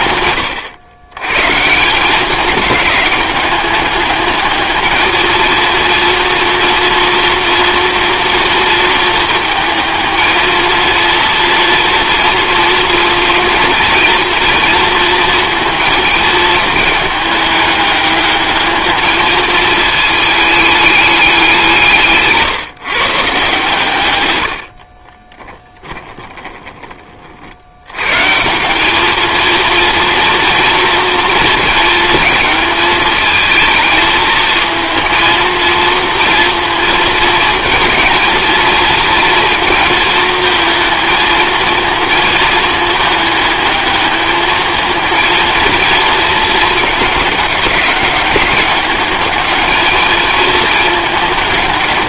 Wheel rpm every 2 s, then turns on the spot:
110, 210, 220, 230, 220, 220, 230, 230, 220, 220, 210, 150, 50, 20, 190, 230, 220, 230, 230, 230, 230, 220, 220, 210, 200, 220.
none